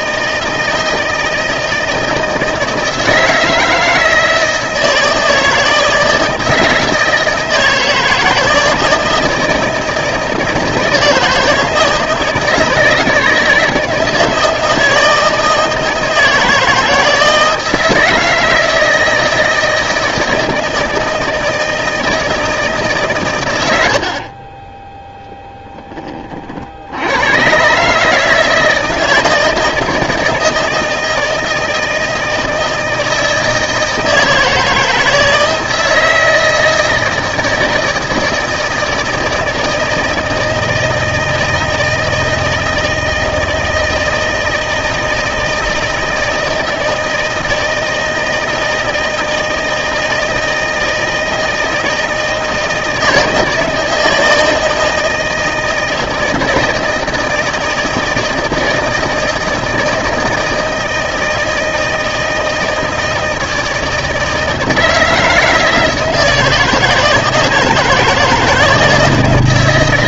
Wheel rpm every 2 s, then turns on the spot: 160, 160, 160, 160, 160, 160, 160, 160, 160, 160, 160, 150, 20, 50, 160, 160, 160, 160, 160, 160, 160, 160, 160, 160, 160, 160, 160, 160, 160, 160, 160, 160, 160, 170, 170.
none